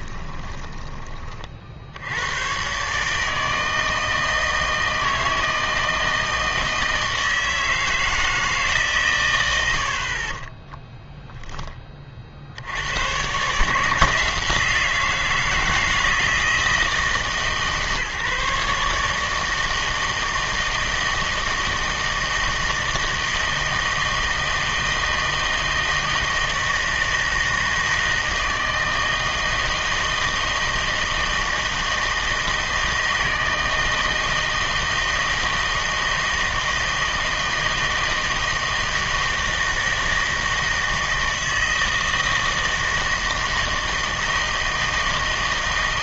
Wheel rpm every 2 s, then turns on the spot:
20, 140, 160, 160, 130, 10, 100, 170, 160, 150, 160, 160, 160, 160, 160, 160, 160, 160, 160, 160, 160, 160, 160.
none